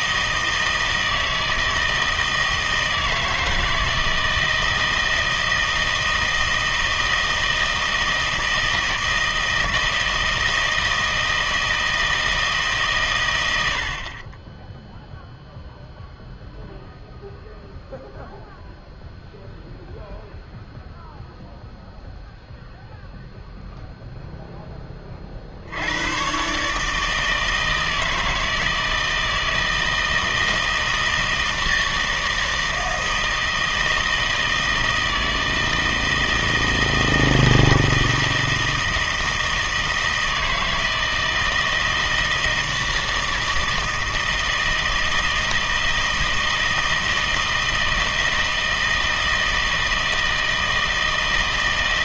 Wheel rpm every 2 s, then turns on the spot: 160, 160, 160, 160, 160, 160, 150, 10, 0, 0, 0, 0, 10, 140, 160, 160, 160, 160, 160, 160, 160, 160, 160, 160, 160, 160.
none